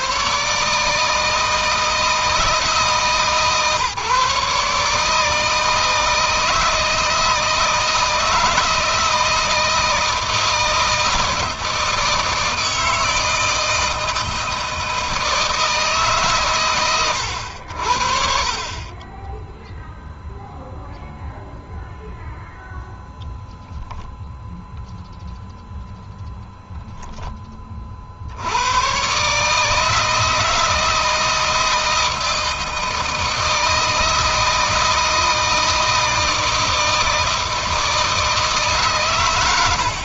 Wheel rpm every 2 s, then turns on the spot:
150, 140, 150, 160, 160, 160, 160, 160, 110, 30, 0, 0, 0, 0, 120, 160, 160, 160, 160, 130.
18-20